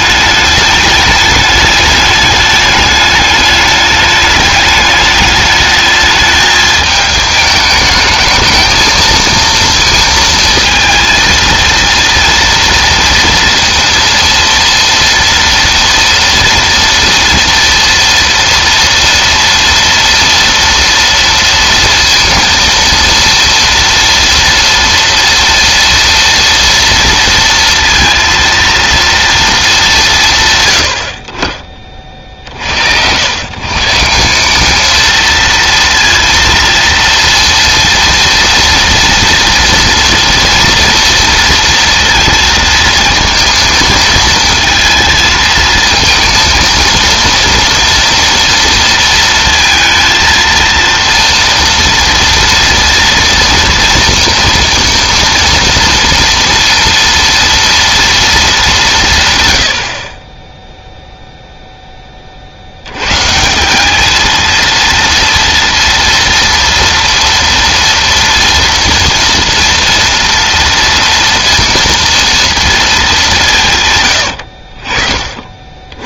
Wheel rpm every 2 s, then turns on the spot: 210, 210, 210, 210, 230, 230, 230, 230, 240, 230, 230, 230, 230, 230, 230, 130, 70, 210, 230, 230, 230, 230, 230, 230, 230, 230, 230, 230, 230, 190, 0, 80, 230, 230, 230, 230, 230, 60.
none